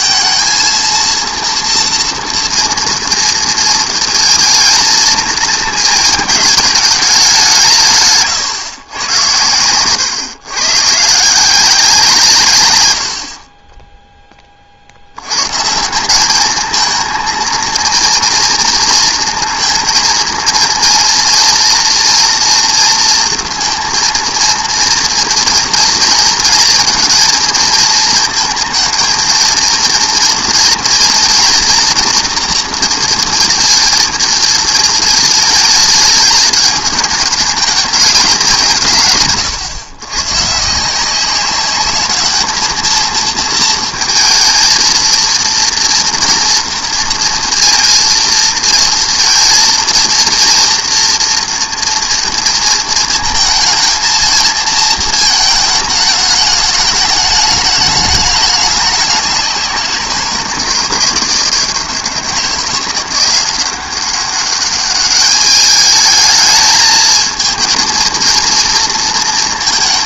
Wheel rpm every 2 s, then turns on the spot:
230, 230, 230, 220, 130, 120, 120, 30, 220, 230, 230, 230, 230, 230, 230, 230, 230, 220, 210, 190, 140, 210, 220, 230, 230, 230, 230, 220, 210, 200, 160, 170, 200, 220, 230.
none